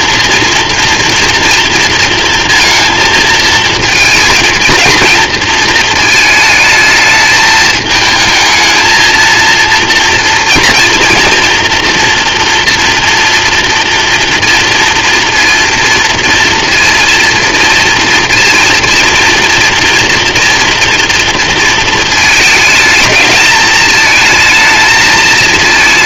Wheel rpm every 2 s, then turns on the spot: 230, 230, 230, 220, 230, 230, 230, 230, 230, 230, 230, 220, 220.
none